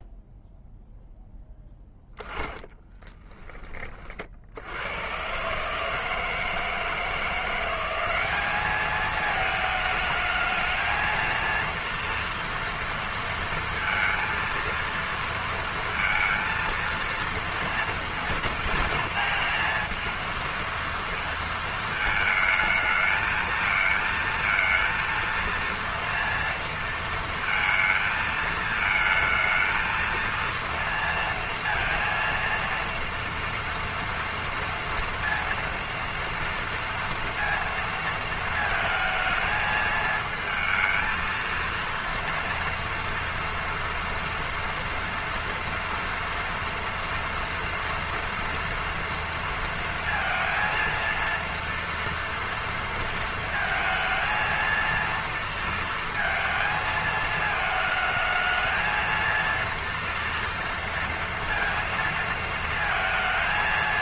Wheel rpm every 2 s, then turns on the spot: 0, 10, 50, 160, 190, 220, 230, 230, 230, 230, 230, 220, 230, 230, 220, 230, 230, 230, 230, 230, 220, 230, 230, 230, 230, 230, 230, 230, 230, 220, 230, 230.
2-4